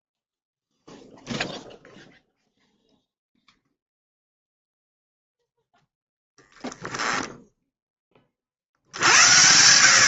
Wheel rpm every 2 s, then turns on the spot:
0, 0, 0, 0, 90.
none